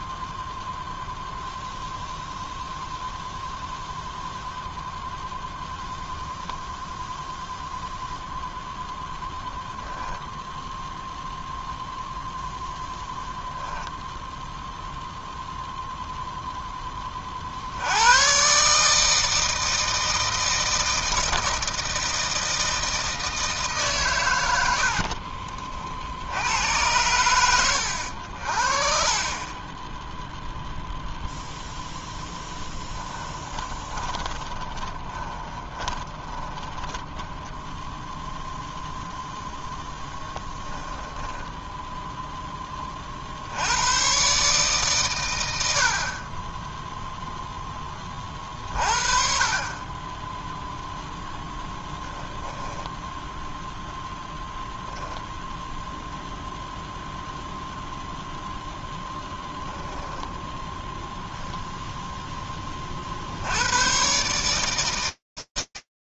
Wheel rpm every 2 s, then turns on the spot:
0, 0, 0, 0, 0, 0, 0, 0, 10, 150, 160, 160, 60, 100, 30, 0, 10, 20, 10, 0, 10, 40, 120, 0, 60, 0, 0, 0, 0, 0, 0, 40, 80.
24-26 32-38 40-42